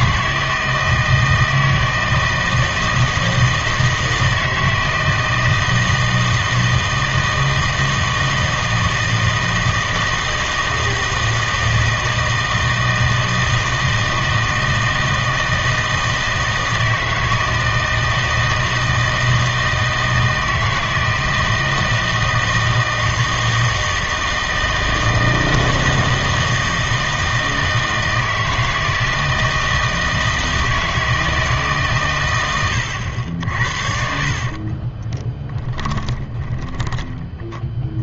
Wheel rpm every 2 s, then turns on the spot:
160, 160, 160, 160, 160, 160, 160, 160, 160, 160, 160, 160, 160, 160, 160, 160, 90, 40, 10.
34-38